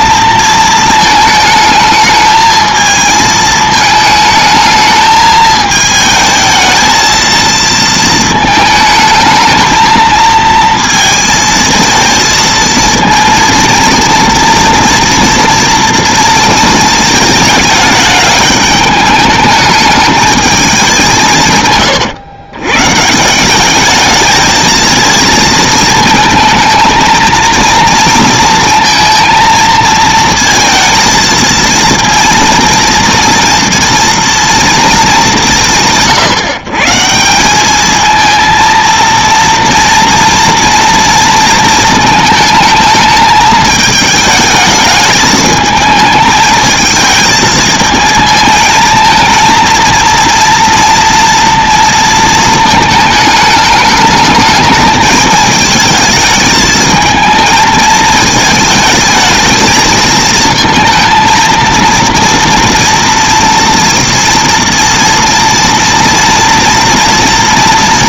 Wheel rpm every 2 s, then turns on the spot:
230, 220, 220, 220, 220, 230, 230, 230, 230, 210, 200, 120, 220, 220, 230, 230, 230, 230, 140, 230, 230, 220, 220, 220, 220, 230, 220, 210, 220, 220, 220, 230, 230, 230.
none